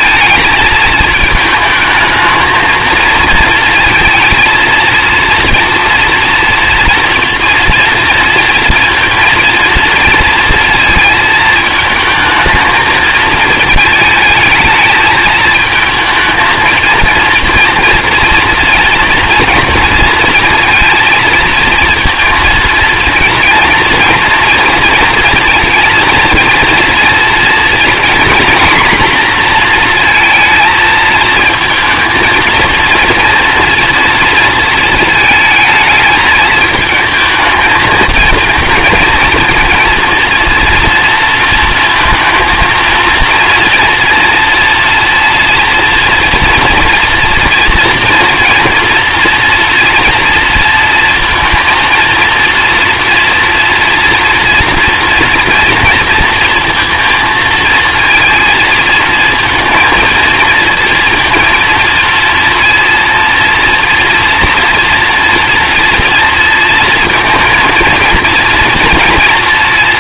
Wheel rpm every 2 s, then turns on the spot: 220, 220, 230, 230, 230, 220, 220, 220, 230, 230, 230, 230, 220, 230, 240, 220, 230, 220, 220, 230, 230, 230, 230, 230, 230, 230, 230, 230, 230, 230, 230, 230, 230, 240, 240.
none